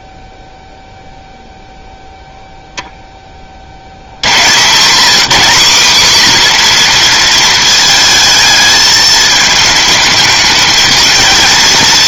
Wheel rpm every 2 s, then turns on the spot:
0, 0, 150, 250, 220, 220.
none